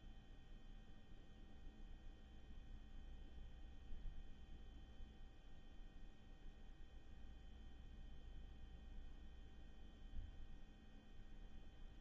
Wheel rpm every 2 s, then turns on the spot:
0, 0, 0, 0, 0, 0.
none